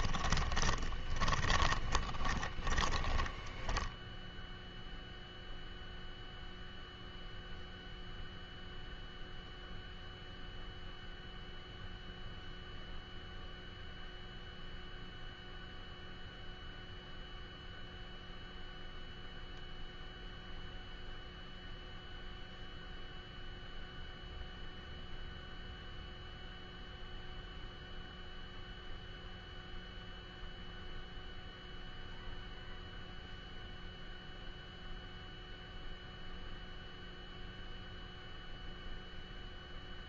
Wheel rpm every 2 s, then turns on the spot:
20, 20, 0, 0, 0, 0, 0, 0, 0, 0, 0, 0, 0, 0, 0, 0, 0, 0, 0, 0.
0-4